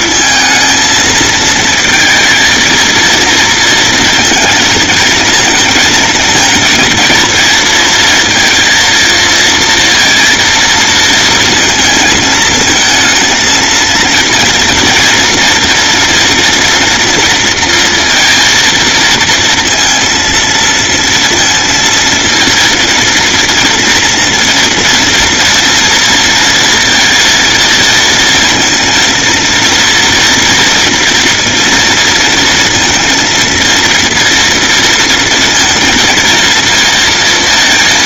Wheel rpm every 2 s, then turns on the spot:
230, 230, 230, 230, 230, 220, 230, 230, 230, 230, 230, 230, 230, 230, 230, 230, 230, 220, 230.
none